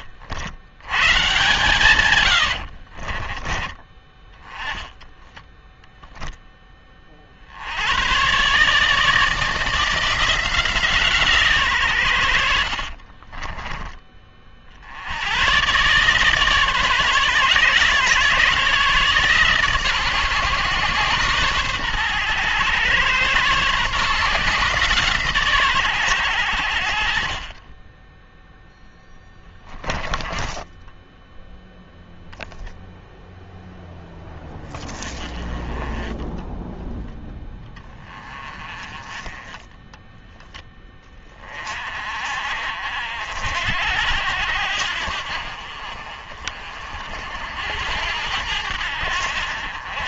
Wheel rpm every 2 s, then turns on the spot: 100, 60, 10, 20, 150, 160, 60, 60, 140, 140, 130, 120, 150, 70, 0, 10, 0, 20, 10, 20, 10, 50, 80, 50, 70.
2-6 12-14 30-32